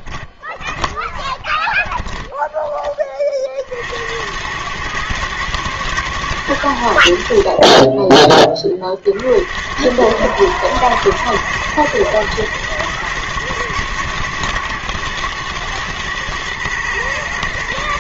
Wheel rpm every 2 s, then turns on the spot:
20, 110, 80, 40, 110, 120, 110, 110, 110.
none